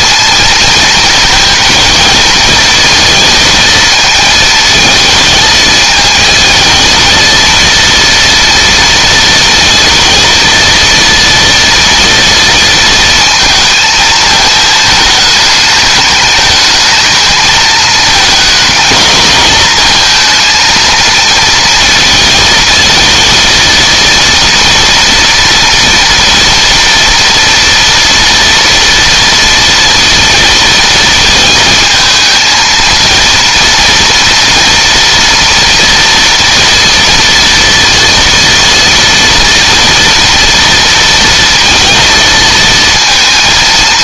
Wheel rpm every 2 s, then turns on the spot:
220, 220, 220, 230, 230, 230, 230, 220, 220, 230, 230, 230, 230, 230, 230, 220, 230, 230, 230, 230, 230, 230.
none